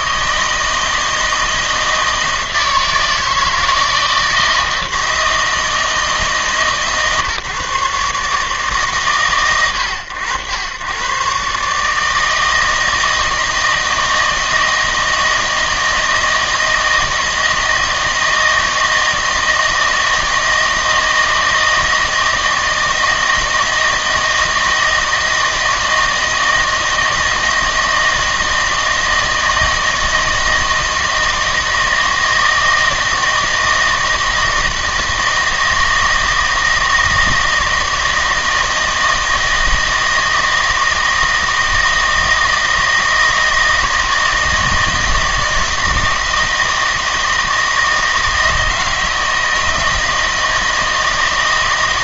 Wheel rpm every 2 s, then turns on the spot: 160, 160, 160, 150, 150, 100, 160, 160, 160, 160, 160, 160, 160, 160, 160, 160, 160, 160, 160, 160, 160, 160, 160, 160, 160, 160.
none